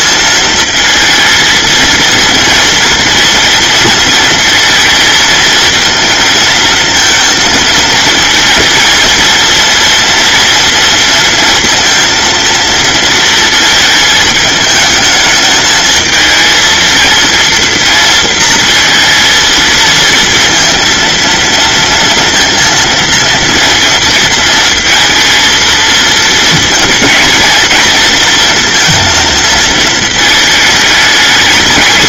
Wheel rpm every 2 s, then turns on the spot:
220, 230, 220, 220, 230, 230, 230, 220, 230, 230, 230, 230, 230, 230, 230, 210.
none